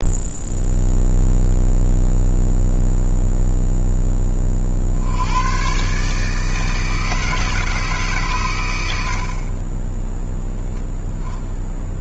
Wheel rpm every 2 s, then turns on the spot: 0, 0, 30, 160, 110, 0.
none